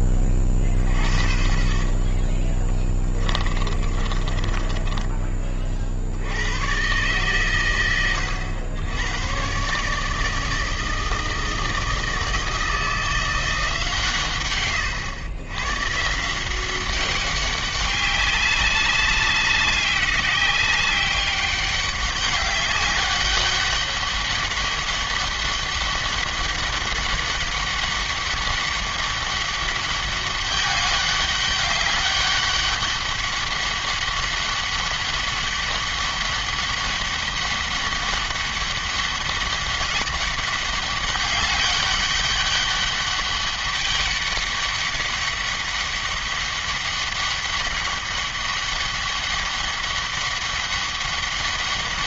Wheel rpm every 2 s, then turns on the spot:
40, 20, 20, 110, 100, 160, 160, 110, 180, 200, 190, 200, 200, 200, 200, 200, 200, 200, 200, 200, 200, 200, 200, 200, 200, 200.
4-6